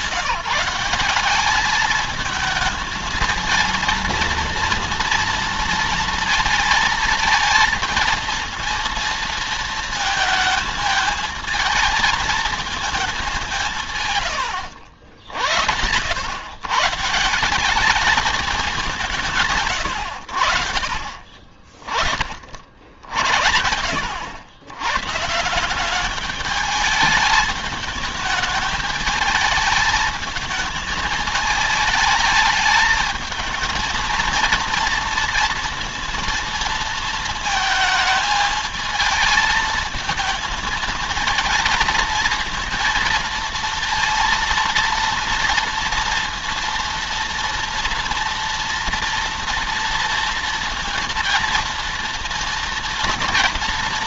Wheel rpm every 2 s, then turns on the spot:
190, 220, 230, 230, 230, 220, 210, 90, 170, 180, 60, 70, 110, 210, 220, 220, 220, 230, 230, 220, 220, 230, 230, 240, 240, 230, 230.
none